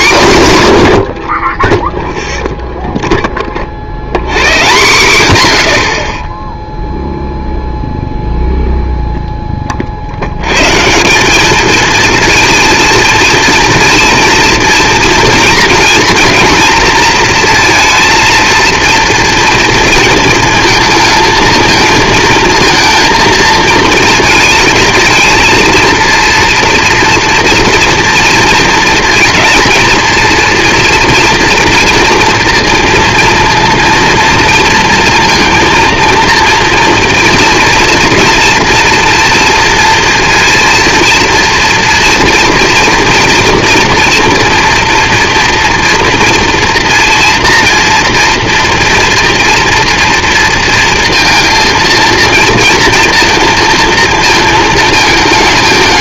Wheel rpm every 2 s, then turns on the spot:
100, 0, 120, 0, 0, 160, 230, 230, 230, 230, 230, 230, 220, 240, 230, 240, 230, 230, 230, 230, 230, 230, 230, 230, 230, 230, 230, 220.
none